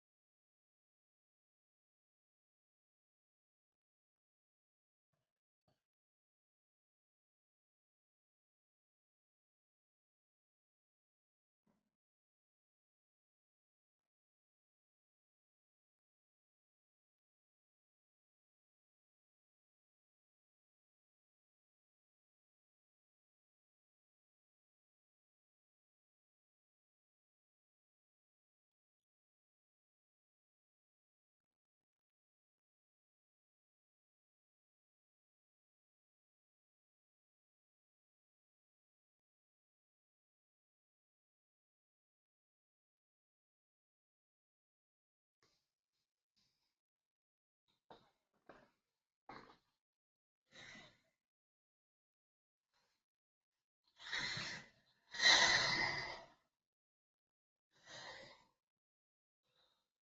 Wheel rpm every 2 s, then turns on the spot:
0, 0, 0, 0, 0, 0, 0, 0, 0, 0, 0, 0, 0, 0, 0, 0, 0, 0, 0, 0, 0, 0, 0, 0, 0, 0, 0, 0, 0, 0.
none